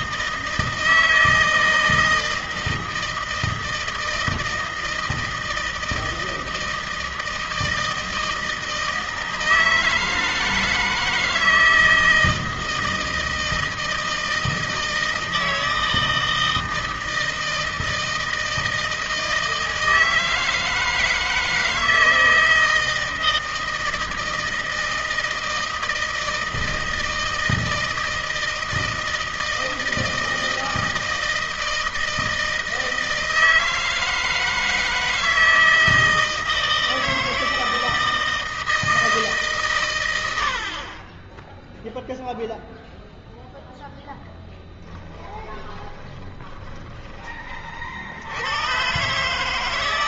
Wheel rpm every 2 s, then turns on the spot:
160, 160, 160, 160, 160, 160, 160, 160, 160, 160, 160, 160, 160, 160, 160, 160, 160, 160, 160, 160, 70, 0, 10, 20, 100.
44-48